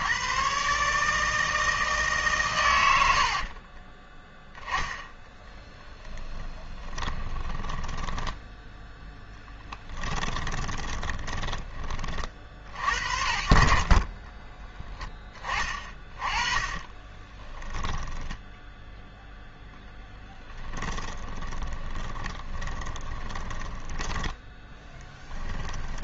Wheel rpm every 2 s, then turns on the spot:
150, 100, 10, 20, 10, 20, 60, 20, 20, 0, 10, 20, 20.
2-4 6-8 10-12 16-18 20-26